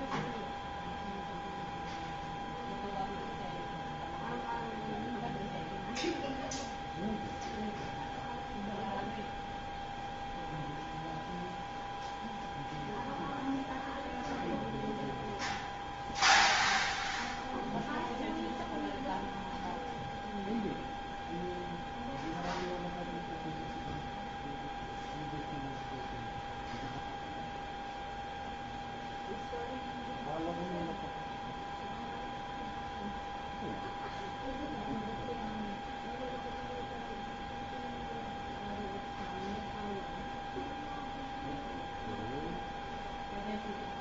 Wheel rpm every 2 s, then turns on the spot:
0, 0, 0, 0, 0, 0, 0, 0, 0, 0, 0, 0, 0, 0, 0, 0, 0, 0, 0, 0, 0, 0.
none